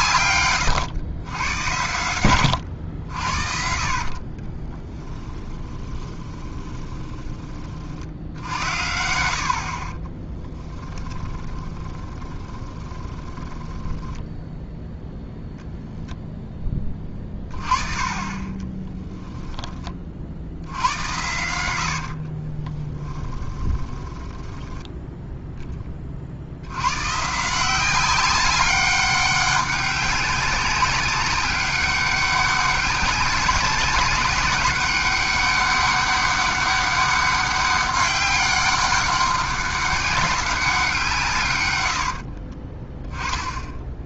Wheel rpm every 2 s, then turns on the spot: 110, 100, 20, 20, 70, 20, 10, 0, 10, 10, 90, 20, 10, 90, 200, 200, 200, 190, 200, 200, 200, 40.
4-8 10-14 18-20 22-26 42-44